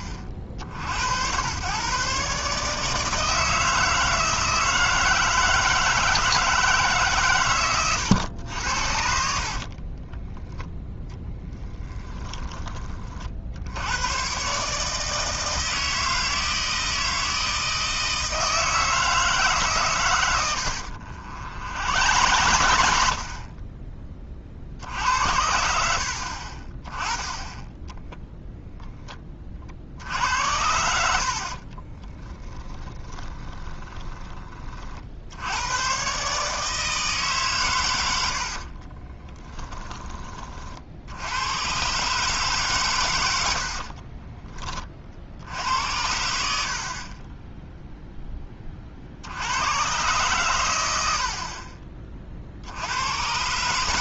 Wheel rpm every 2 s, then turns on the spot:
70, 150, 160, 160, 80, 10, 30, 150, 160, 160, 80, 70, 60, 20, 0, 70, 20, 40, 150, 50, 60, 120, 30, 60, 40, 100, 70.
20-24 32-34 38-40